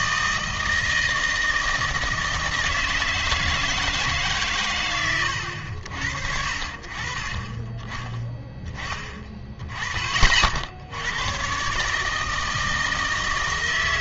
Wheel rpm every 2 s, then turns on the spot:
160, 160, 130, 60, 10, 60, 160.
none